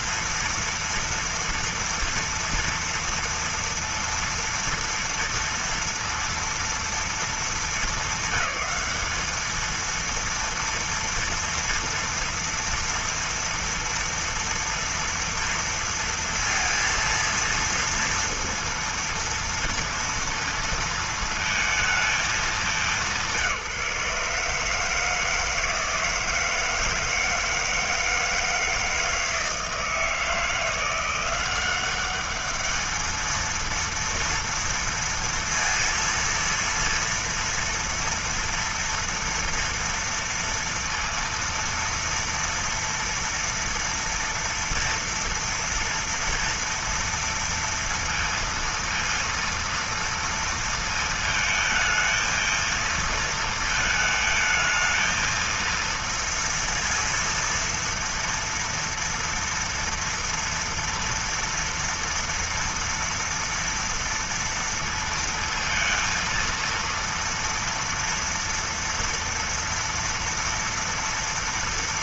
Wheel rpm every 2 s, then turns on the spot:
230, 240, 230, 220, 200, 240, 230, 230, 230, 230, 230, 190, 150, 160, 160, 170, 220, 230, 230, 230, 230, 230, 230, 230, 230, 230, 230, 220, 230, 230, 230, 230, 230, 230, 230, 230.
none